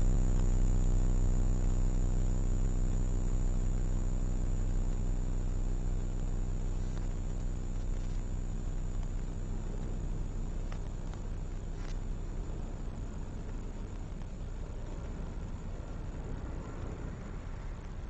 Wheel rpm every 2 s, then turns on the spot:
0, 0, 0, 0, 0, 0, 0, 0, 0.
none